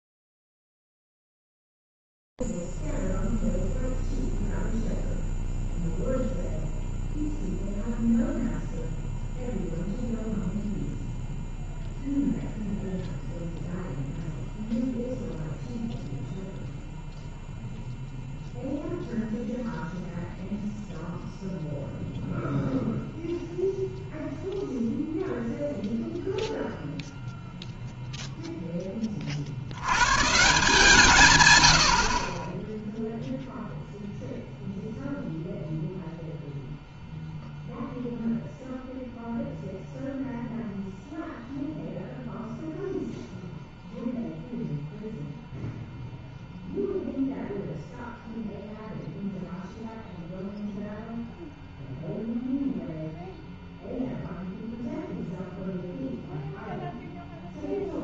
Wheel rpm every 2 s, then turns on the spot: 0, 0, 0, 0, 0, 0, 0, 0, 0, 0, 0, 0, 0, 0, 0, 130, 20, 0, 0, 0, 0, 0, 0, 0, 0, 0, 0, 0, 0.
none